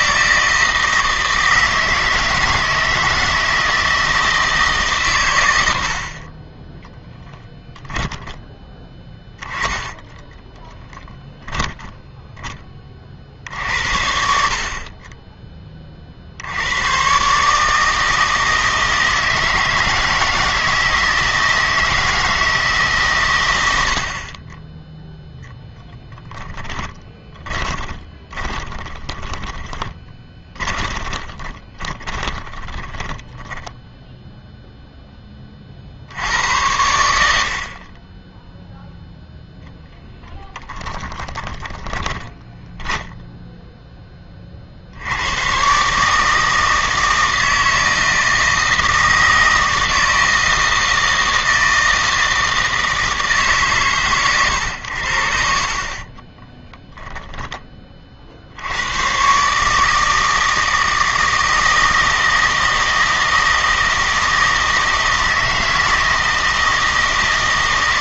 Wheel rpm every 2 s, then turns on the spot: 160, 160, 150, 10, 10, 10, 20, 40, 100, 160, 160, 150, 20, 10, 20, 20, 20, 0, 90, 0, 10, 10, 50, 160, 160, 160, 160, 100, 10, 80, 160, 160, 160, 160.
10-12 26-34 40-44 56-58